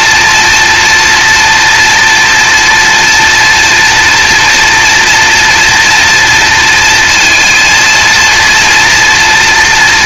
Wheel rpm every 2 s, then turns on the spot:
240, 240, 230, 230, 230.
none